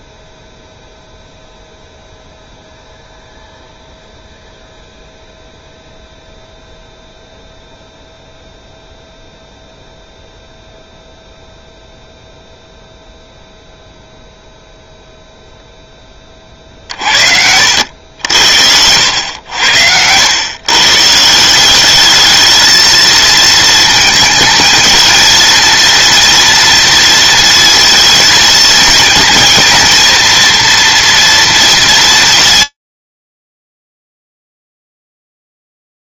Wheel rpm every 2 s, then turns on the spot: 0, 0, 0, 0, 0, 0, 0, 0, 50, 80, 130, 220, 220, 230, 220, 230, 80, 0.
none